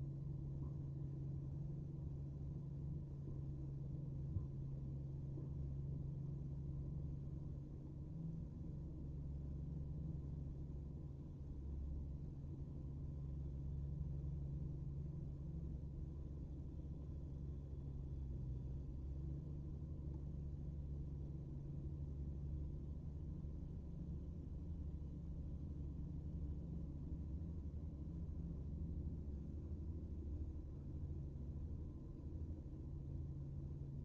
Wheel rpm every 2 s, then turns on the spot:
0, 0, 0, 0, 0, 0, 0, 0, 0, 0, 0, 0, 0, 0, 0, 0, 0.
none